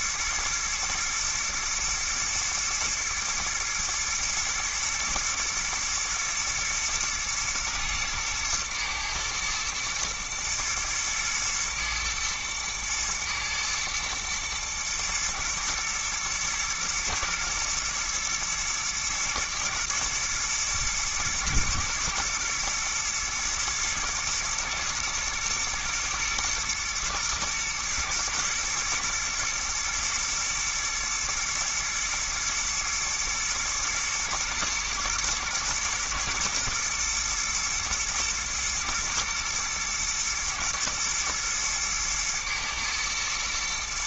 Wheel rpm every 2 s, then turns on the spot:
110, 110, 120, 120, 110, 120, 120, 120, 120, 110, 110, 110, 110, 110, 110, 110, 110, 110, 110, 110, 110, 110.
none